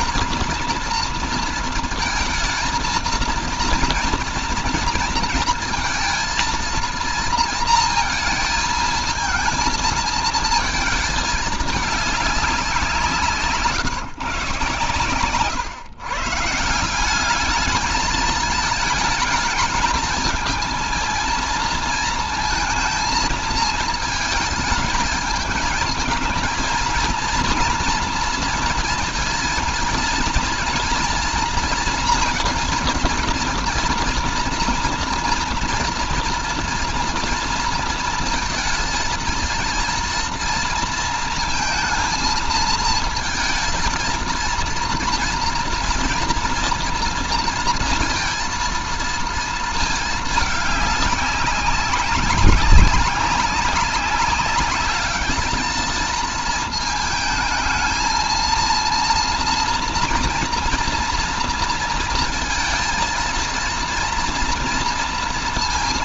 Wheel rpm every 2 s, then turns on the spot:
230, 230, 230, 230, 230, 220, 190, 130, 160, 220, 220, 230, 220, 220, 230, 230, 230, 230, 240, 230, 230, 230, 230, 230, 230, 200, 190, 200, 230, 230, 230, 230, 230.
none